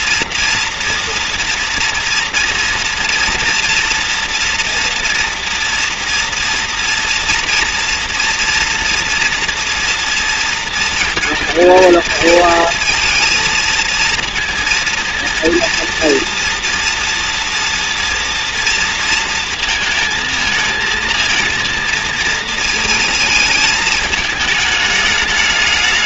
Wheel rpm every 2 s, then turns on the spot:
230, 230, 230, 230, 230, 220, 220, 230, 230, 230, 220, 230, 220.
none